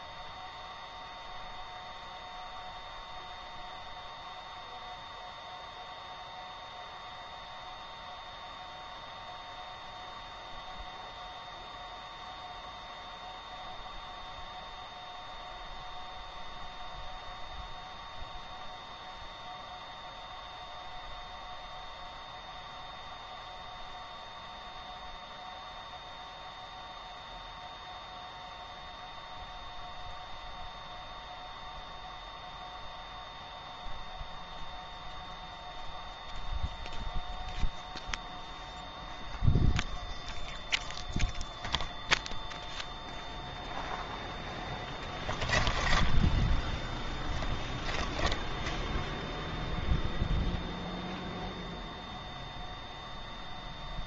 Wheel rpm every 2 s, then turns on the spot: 0, 0, 0, 0, 0, 0, 0, 0, 0, 0, 0, 0, 0, 0, 0, 0, 0, 0, 0, 0, 0, 0, 10, 10, 0, 0, 0.
44-48